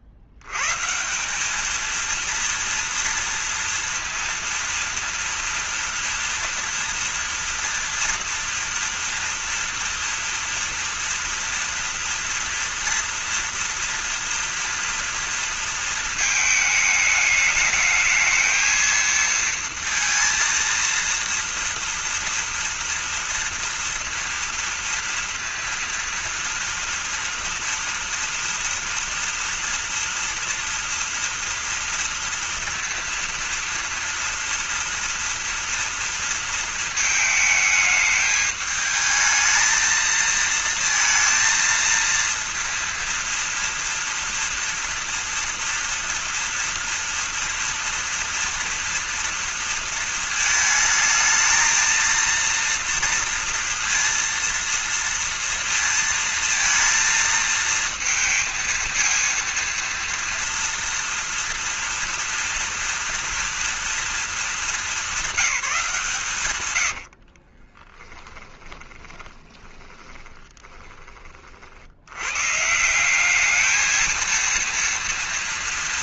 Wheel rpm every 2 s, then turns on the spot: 110, 230, 230, 230, 230, 230, 230, 230, 220, 220, 230, 230, 230, 230, 230, 230, 230, 230, 230, 210, 230, 230, 230, 230, 230, 220, 230, 230, 230, 230, 230, 230, 220, 130, 20, 20, 130, 230.
68-72